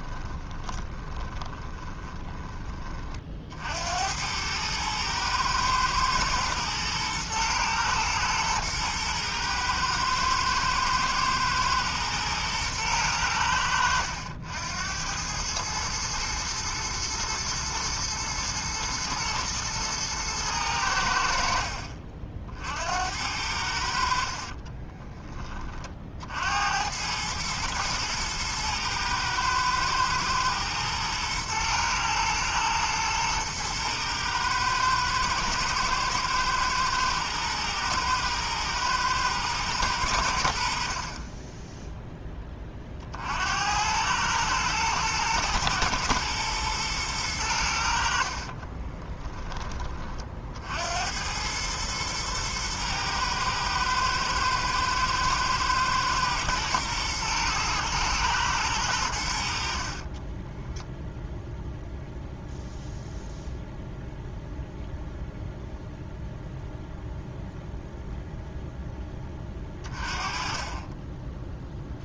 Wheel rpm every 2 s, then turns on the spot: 20, 30, 110, 110, 110, 110, 110, 90, 110, 110, 90, 70, 30, 90, 110, 120, 110, 110, 110, 120, 60, 40, 110, 120, 40, 80, 120, 110, 110, 100, 0, 0, 0, 0, 10, 20.
0-2 24-26 40-42 48-50